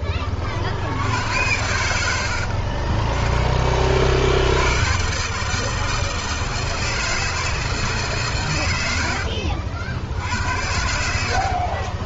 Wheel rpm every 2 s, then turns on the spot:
60, 40, 110, 160, 110, 70.
2-4